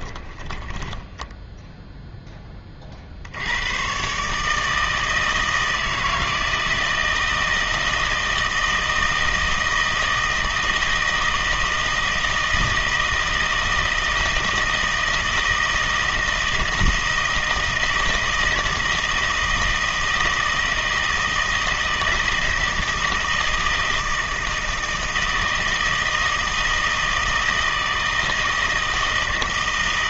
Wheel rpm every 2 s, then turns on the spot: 20, 30, 160, 160, 160, 160, 160, 160, 160, 160, 160, 160, 160, 160, 160.
0-2